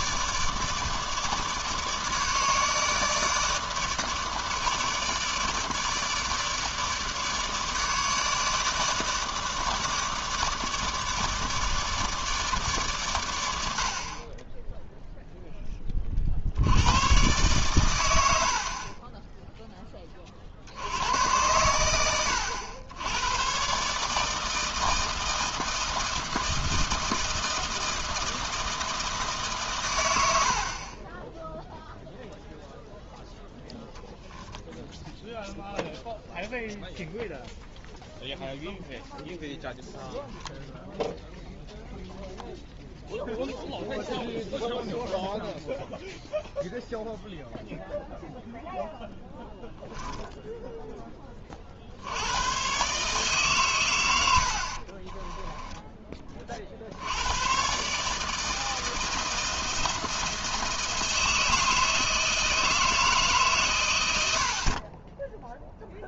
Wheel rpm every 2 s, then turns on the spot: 150, 150, 150, 150, 150, 150, 140, 10, 70, 60, 60, 90, 160, 160, 160, 60, 0, 0, 0, 0, 0, 0, 0, 0, 0, 0, 120, 70, 50, 160, 160, 160, 50.
none